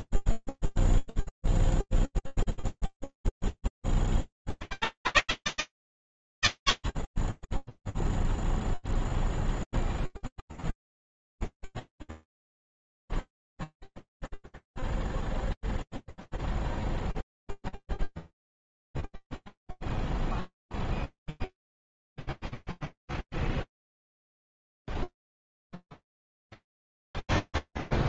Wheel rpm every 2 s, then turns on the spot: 0, 30, 80, 0, 0, 0, 0, 0, 0, 0, 0, 0, 0, 0.
none